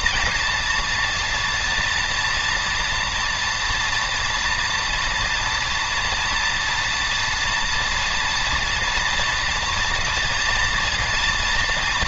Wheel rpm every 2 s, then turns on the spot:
230, 240, 230, 240, 240, 230.
none